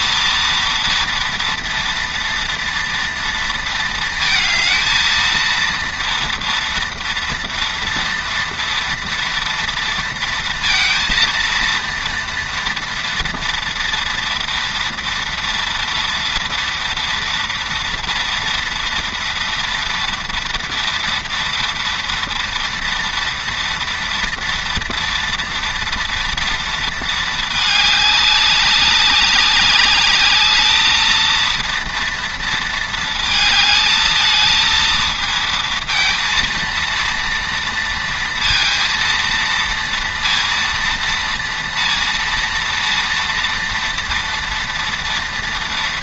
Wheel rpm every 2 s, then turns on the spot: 230, 230, 220, 230, 230, 230, 230, 230, 230, 240, 230, 230, 230, 230, 200, 210, 230, 220, 230, 230, 230, 230, 230.
none